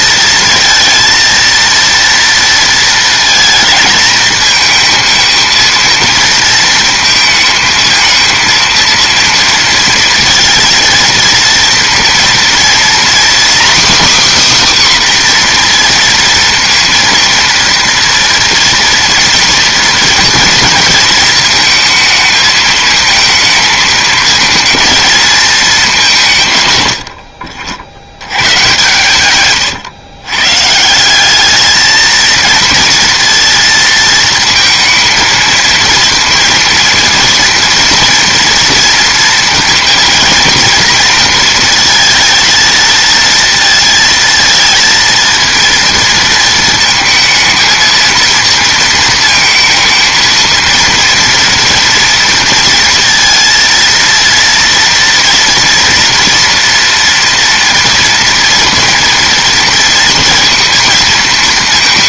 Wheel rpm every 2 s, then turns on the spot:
230, 230, 220, 230, 230, 230, 240, 280, 230, 230, 230, 220, 230, 130, 130, 130, 230, 220, 230, 230, 220, 220, 220, 230, 230, 230, 230, 230, 240, 230, 230.
none